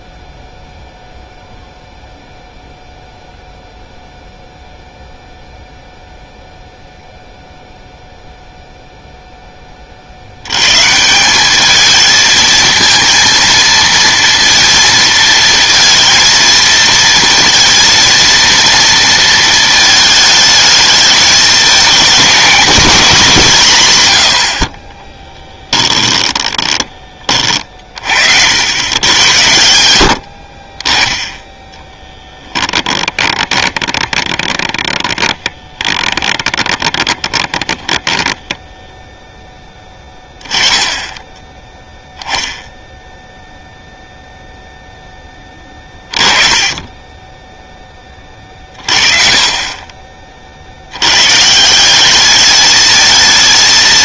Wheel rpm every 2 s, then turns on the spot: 0, 0, 0, 0, 0, 110, 220, 230, 230, 230, 220, 220, 50, 10, 80, 40, 10, 20, 20, 10, 10, 0, 0, 20, 30, 80, 220.
26-28 32-40